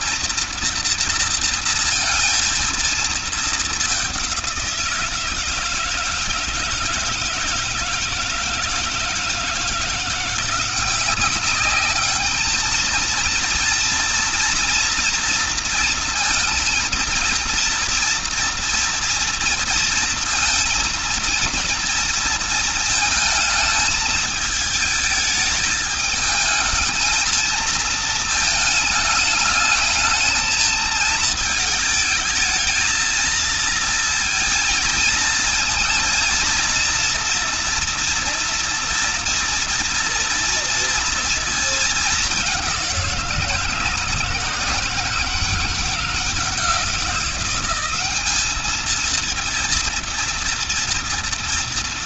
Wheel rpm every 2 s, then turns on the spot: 230, 220, 170, 160, 160, 190, 220, 230, 230, 230, 230, 220, 220, 220, 220, 220, 220, 230, 230, 230, 230, 190, 170, 180, 220, 230.
none